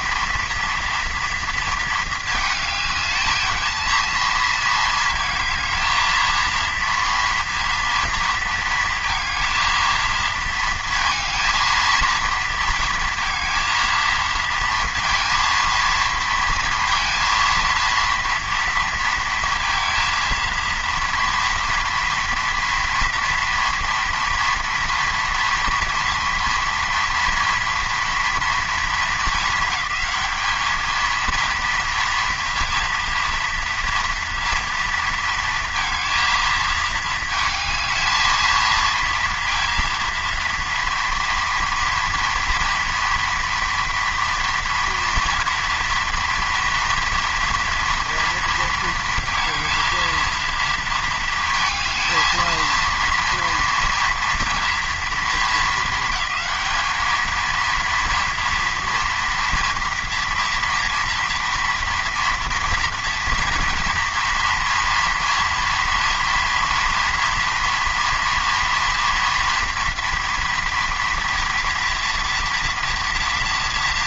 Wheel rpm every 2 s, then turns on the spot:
230, 220, 230, 230, 230, 230, 230, 230, 230, 230, 230, 230, 230, 230, 230, 220, 230, 230, 230, 230, 230, 240, 240, 240, 230, 230, 230, 230, 210, 230, 230, 230, 230, 230, 230, 230, 230.
none